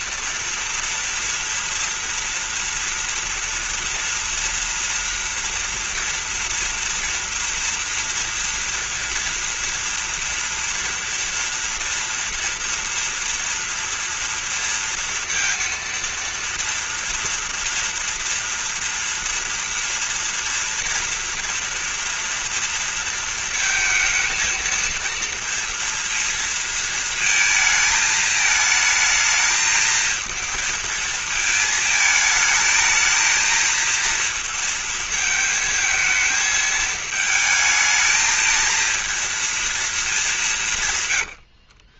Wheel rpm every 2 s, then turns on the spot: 240, 230, 230, 230, 230, 230, 230, 230, 230, 230, 230, 230, 230, 230, 220, 220, 220, 220, 220, 220, 210.
none